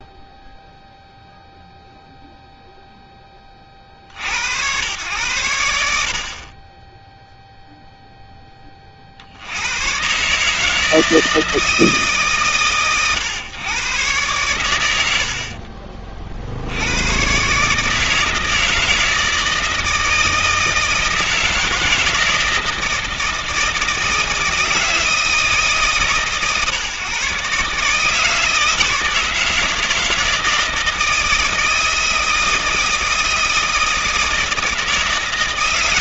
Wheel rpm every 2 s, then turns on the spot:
0, 0, 80, 40, 10, 150, 120, 110, 60, 160, 160, 160, 160, 130, 160, 160, 160, 160.
none